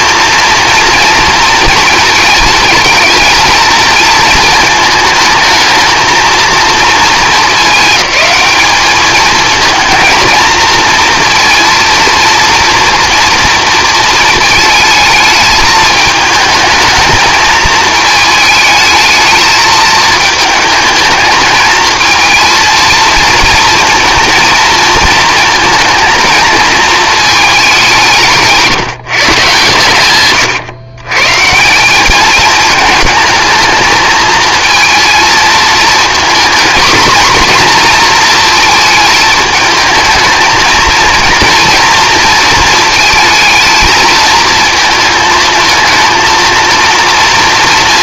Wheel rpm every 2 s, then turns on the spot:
230, 220, 220, 220, 210, 230, 240, 220, 220, 220, 220, 230, 230, 220, 160, 130, 210, 230, 230, 220, 220, 230, 230, 230.
none